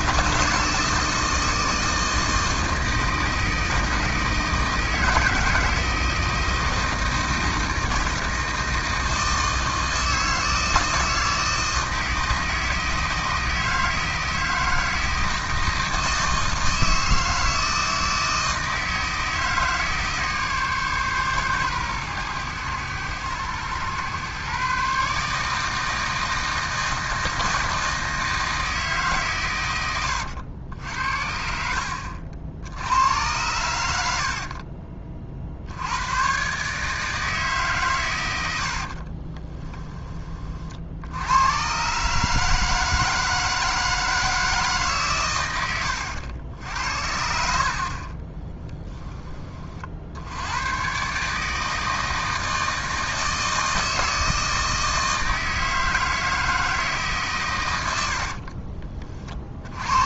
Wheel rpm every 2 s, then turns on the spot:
160, 160, 160, 160, 160, 160, 160, 160, 160, 160, 140, 110, 140, 160, 160, 80, 80, 40, 140, 80, 50, 160, 150, 70, 10, 110, 160, 160, 160, 40.
34-36 38-40 58-60